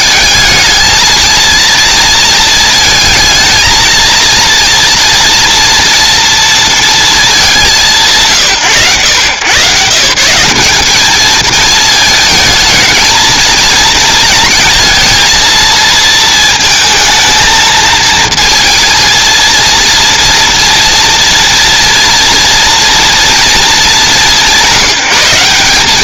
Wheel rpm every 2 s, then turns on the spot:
220, 220, 230, 240, 110, 190, 220, 220, 220, 220, 230, 230, 170.
none